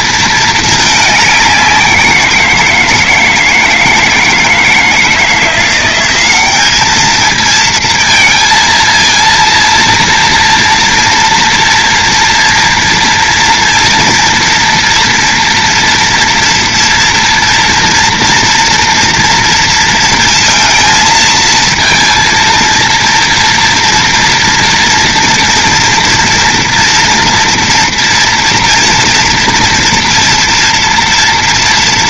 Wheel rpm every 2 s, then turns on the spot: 220, 170, 160, 200, 230, 230, 230, 240, 230, 230, 230, 230, 240, 230, 230, 230.
none